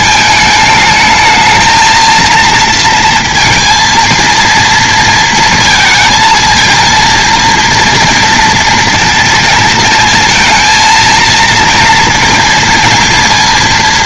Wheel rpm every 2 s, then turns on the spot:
220, 230, 230, 230, 230, 220, 230.
none